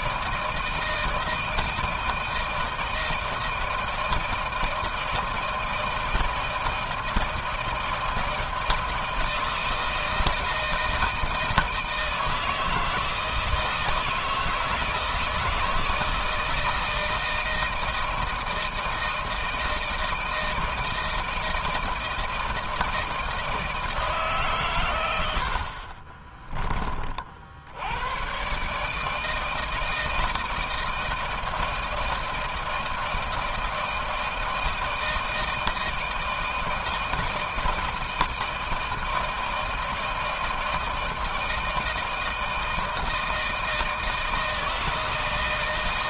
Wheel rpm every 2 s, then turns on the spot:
160, 160, 170, 160, 160, 160, 160, 160, 160, 160, 160, 160, 140, 30, 130, 160, 160, 160, 160, 160, 160, 160, 160.
none